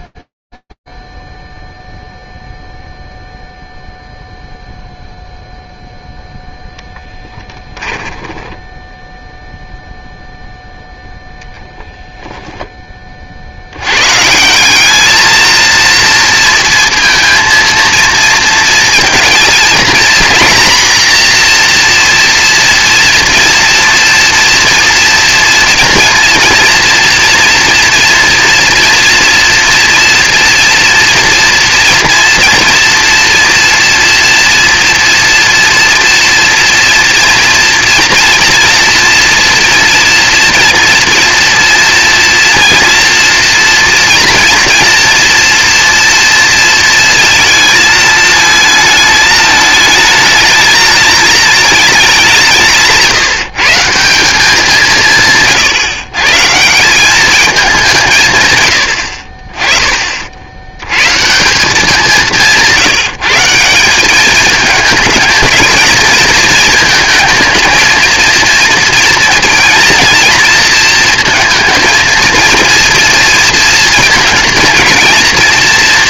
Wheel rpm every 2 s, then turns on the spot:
0, 0, 0, 0, 10, 10, 50, 230, 230, 230, 250, 230, 230, 230, 230, 240, 230, 230, 240, 230, 230, 240, 230, 220, 220, 220, 150, 140, 210, 50, 150, 160, 220, 220, 230, 230, 230, 220.
8-10